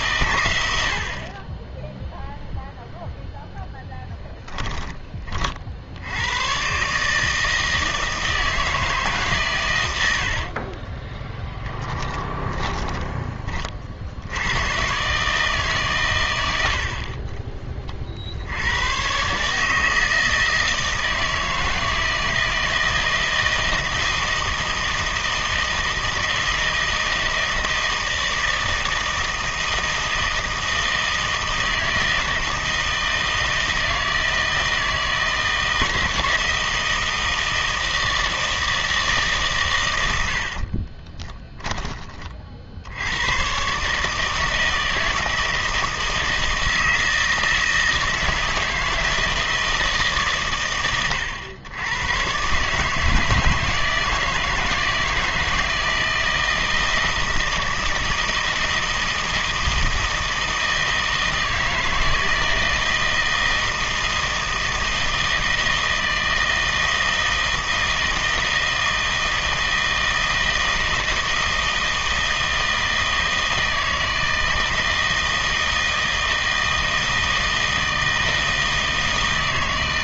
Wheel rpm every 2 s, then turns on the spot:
90, 0, 10, 130, 160, 20, 10, 120, 70, 100, 160, 160, 160, 160, 160, 160, 160, 160, 160, 160, 50, 70, 160, 160, 160, 100, 150, 160, 160, 160, 160, 160, 160, 160, 160, 160, 160, 160, 160, 160.
10-14 40-42